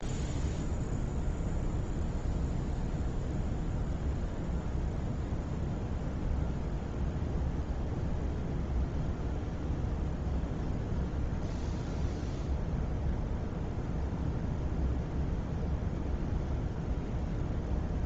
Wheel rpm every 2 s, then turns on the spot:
0, 0, 0, 0, 0, 0, 0, 0, 0.
none